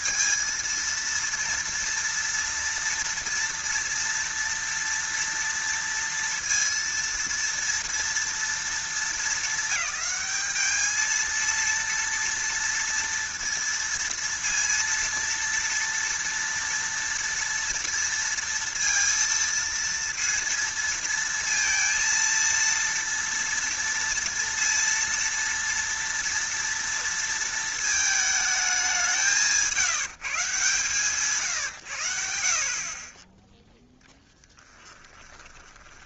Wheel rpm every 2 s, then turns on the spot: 230, 230, 230, 230, 220, 210, 230, 230, 230, 230, 230, 230, 230, 230, 210, 160, 40, 10.
34-36